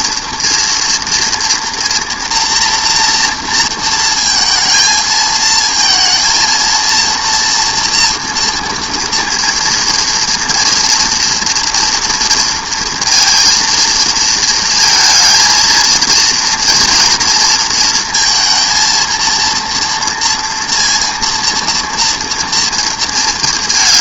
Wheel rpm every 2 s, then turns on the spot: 230, 240, 230, 230, 230, 230, 230, 230, 230, 230, 230, 230.
none